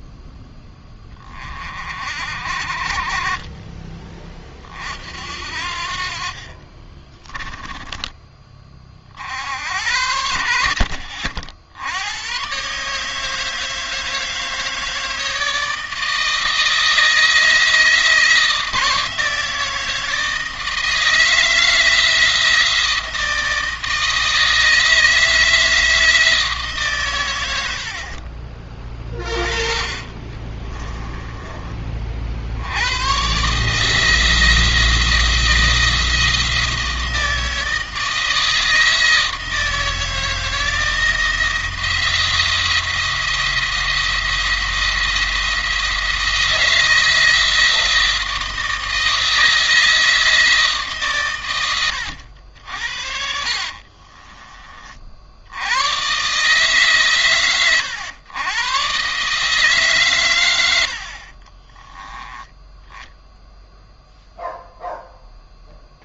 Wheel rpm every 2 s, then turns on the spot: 20, 40, 50, 30, 50, 80, 140, 160, 160, 160, 160, 160, 160, 120, 20, 20, 120, 160, 160, 160, 160, 170, 170, 160, 160, 140, 60, 50, 140, 130, 70, 10, 0.
6-8 30-32 60-62